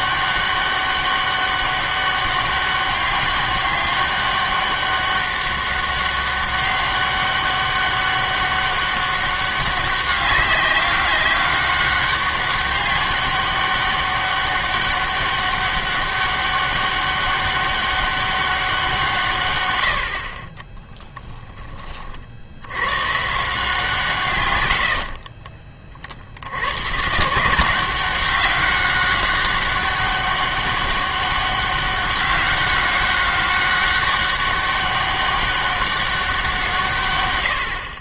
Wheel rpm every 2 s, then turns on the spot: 200, 200, 200, 200, 200, 200, 200, 200, 200, 190, 20, 90, 110, 100, 200, 200, 200, 200, 180.
20-22